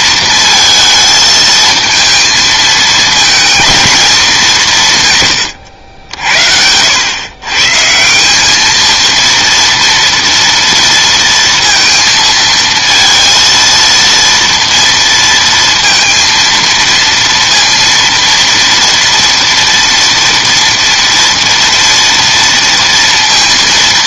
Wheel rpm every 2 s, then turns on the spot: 230, 220, 170, 90, 220, 230, 230, 230, 230, 230, 230, 230.
none